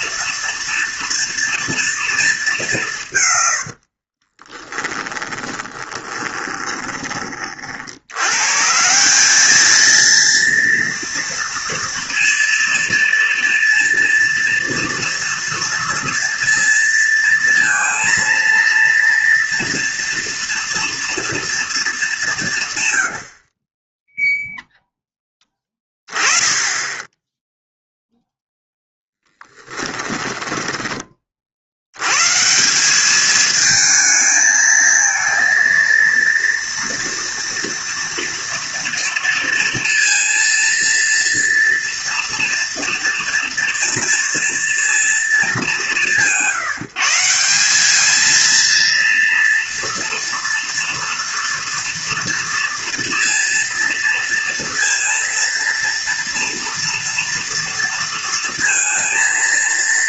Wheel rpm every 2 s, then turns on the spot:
230, 170, 10, 20, 160, 230, 230, 230, 230, 230, 230, 120, 0, 10, 10, 20, 190, 220, 230, 230, 230, 230, 230, 170, 230, 230, 230, 230, 230, 230.
4-8